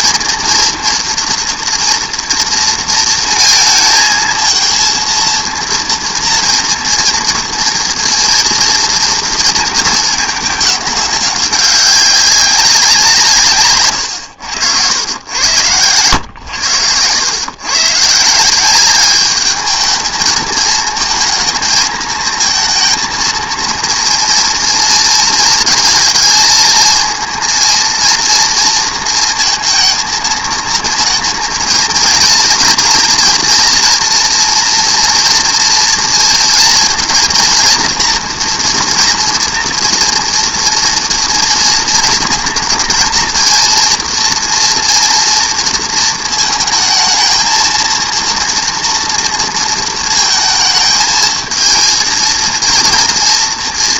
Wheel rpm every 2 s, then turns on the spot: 230, 230, 220, 230, 230, 200, 180, 90, 110, 180, 220, 230, 230, 220, 230, 230, 230, 230, 230, 230, 240, 230, 240, 230, 230, 220, 230.
none